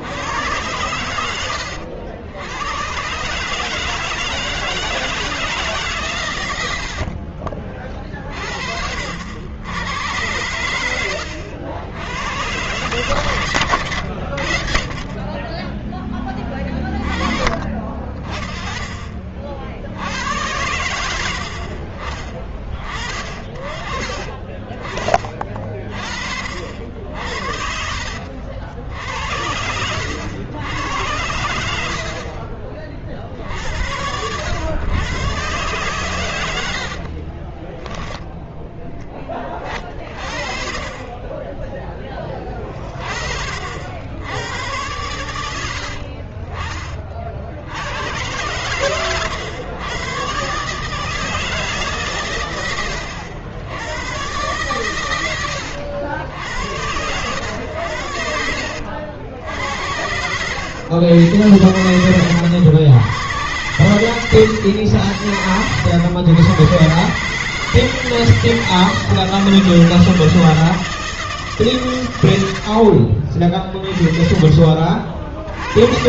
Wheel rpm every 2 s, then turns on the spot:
110, 120, 160, 80, 60, 100, 120, 50, 30, 40, 90, 20, 30, 60, 60, 90, 40, 110, 70, 10, 30, 40, 100, 40, 110, 140, 80, 120, 90, 80, 90, 100, 100, 130, 160, 160, 60, 50.
6-8 36-38